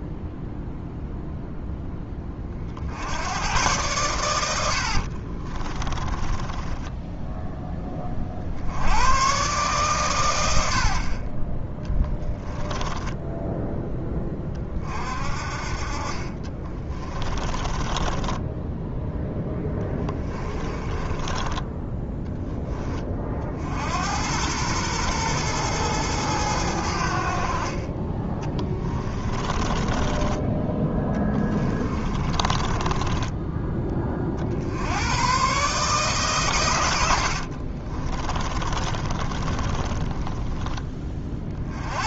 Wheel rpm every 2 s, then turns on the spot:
0, 70, 50, 10, 90, 60, 10, 40, 20, 10, 20, 20, 110, 80, 20, 10, 20, 90, 90, 20, 20.
4-8 10-14 16-18 20-22 28-30 32-34 38-40